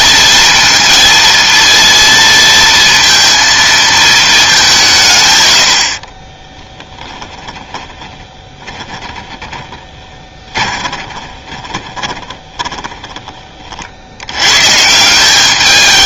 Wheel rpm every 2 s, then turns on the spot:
230, 230, 190, 20, 20, 20, 30, 130.
6-14